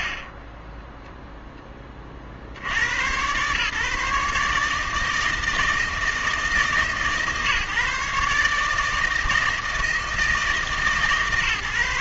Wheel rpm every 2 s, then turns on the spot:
30, 80, 150, 150, 150, 150.
none